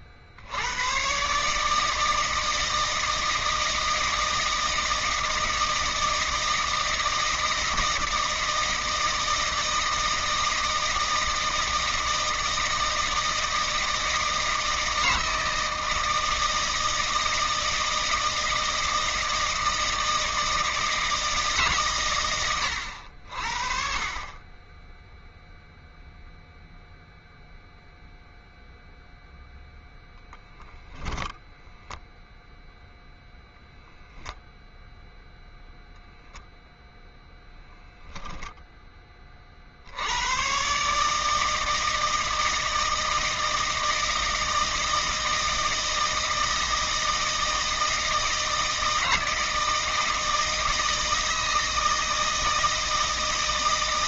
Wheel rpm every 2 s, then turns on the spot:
80, 160, 160, 160, 160, 160, 160, 160, 160, 170, 160, 100, 20, 0, 0, 0, 0, 0, 0, 0, 110, 160, 160, 160, 160, 160, 160.
none